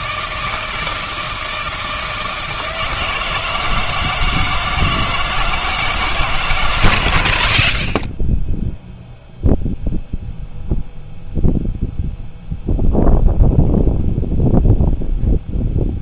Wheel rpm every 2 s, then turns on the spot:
160, 160, 160, 90, 0, 0, 0, 0.
none